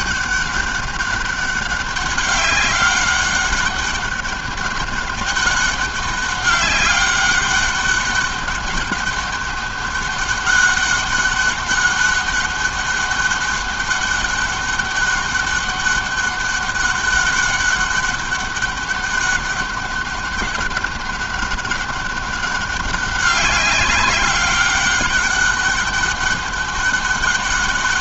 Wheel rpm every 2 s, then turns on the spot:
200, 200, 200, 200, 200, 200, 200, 200, 200, 200, 200, 190, 200, 200.
none